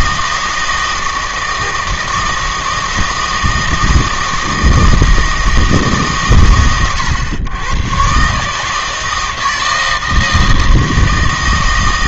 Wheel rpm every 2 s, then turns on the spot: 160, 160, 160, 110, 150, 160.
none